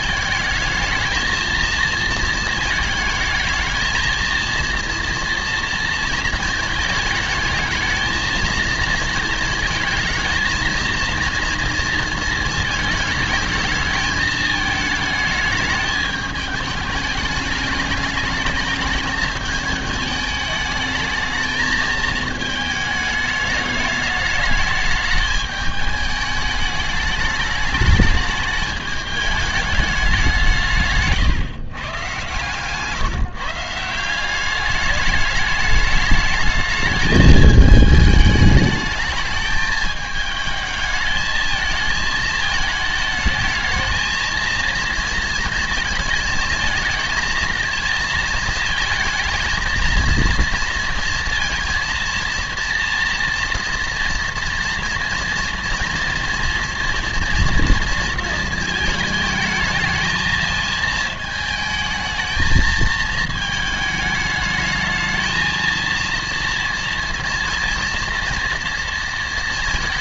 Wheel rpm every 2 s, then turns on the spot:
220, 230, 230, 230, 220, 230, 220, 210, 210, 210, 220, 220, 220, 210, 210, 160, 140, 200, 220, 210, 220, 220, 230, 220, 230, 230, 230, 230, 230, 220, 220, 220, 210, 230, 230.
none